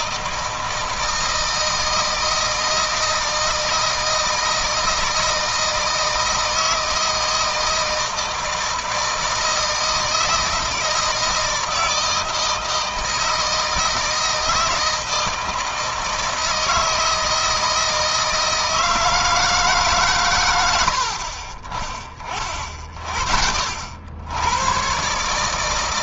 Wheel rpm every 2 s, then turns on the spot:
160, 160, 160, 160, 160, 160, 160, 160, 160, 160, 90, 40, 110.
none